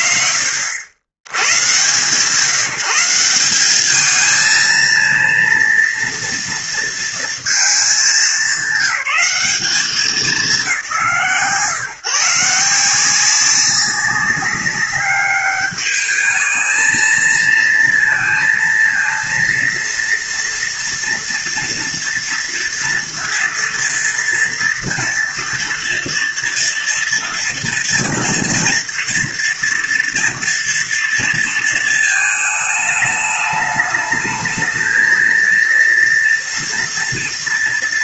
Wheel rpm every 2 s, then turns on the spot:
110, 190, 230, 220, 200, 160, 180, 200, 230, 230, 230, 230, 230, 230, 230, 230, 210, 230, 230.
none